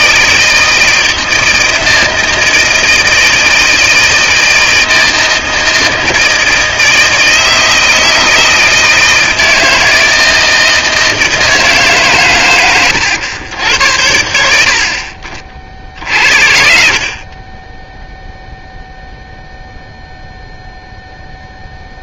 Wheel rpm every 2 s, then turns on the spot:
160, 160, 160, 160, 160, 160, 120, 60, 60, 0, 0.
none